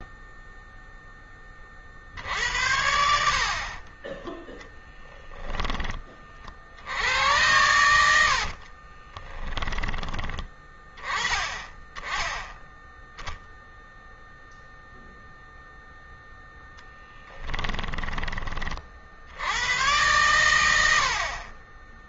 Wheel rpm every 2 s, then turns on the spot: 10, 60, 10, 90, 30, 20, 0, 0, 10, 80, 70.
8-10 16-18 20-22